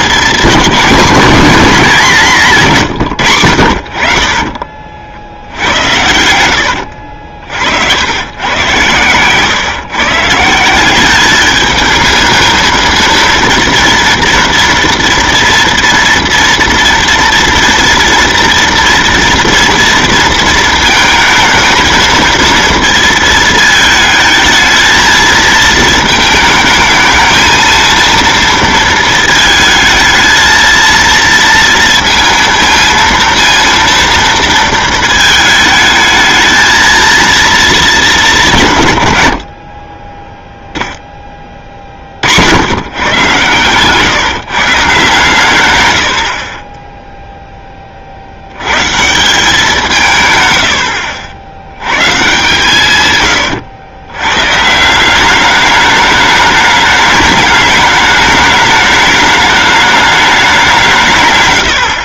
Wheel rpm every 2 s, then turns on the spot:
220, 160, 40, 80, 110, 180, 220, 230, 230, 230, 220, 230, 220, 220, 230, 230, 230, 230, 220, 150, 0, 100, 160, 20, 110, 90, 140, 150, 210, 210, 180.
none